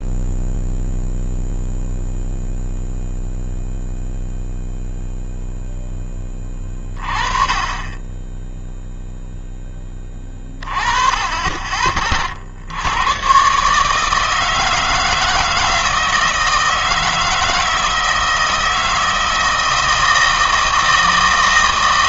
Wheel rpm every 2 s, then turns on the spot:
0, 0, 0, 30, 0, 30, 80, 160, 160, 160, 160.
none